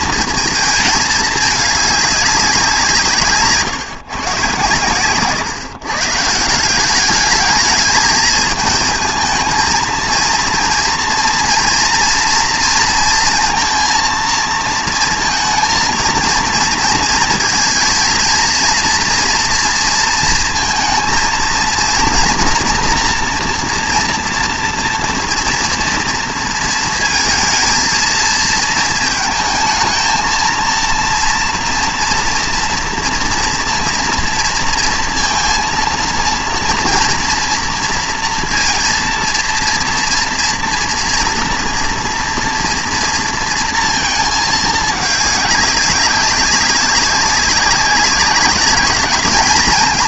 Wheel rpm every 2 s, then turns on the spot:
220, 180, 120, 190, 220, 230, 230, 230, 230, 230, 220, 240, 230, 230, 220, 230, 230, 230, 230, 230, 230, 230, 210, 190, 210.
none